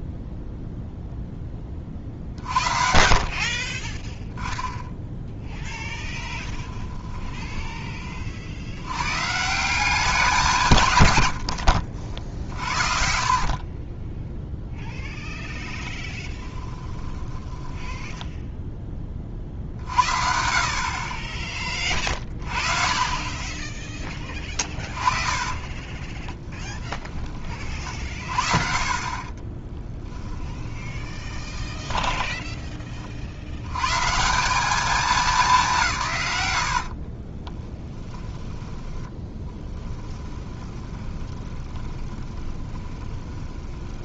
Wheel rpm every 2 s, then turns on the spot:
0, 50, 10, 20, 90, 150, 60, 0, 10, 10, 40, 30, 30, 10, 40, 20, 20, 200, 80, 10, 20, 20.
6-8 12-14 16-18 24-28 30-32 36-44